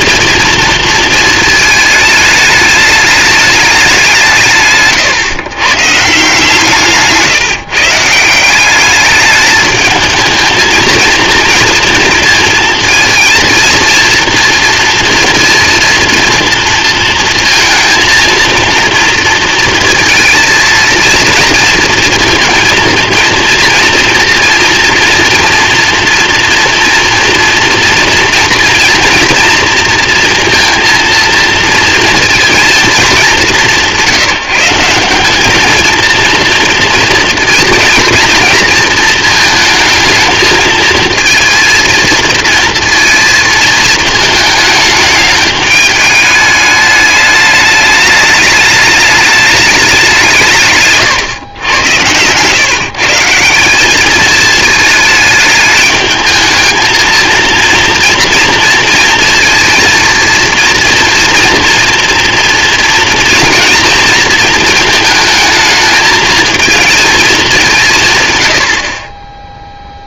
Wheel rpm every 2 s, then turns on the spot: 230, 210, 150, 160, 190, 220, 230, 230, 230, 230, 230, 230, 230, 230, 230, 230, 220, 170, 230, 220, 220, 230, 210, 210, 210, 140, 140, 220, 220, 230, 230, 230, 220, 230, 70.
4-6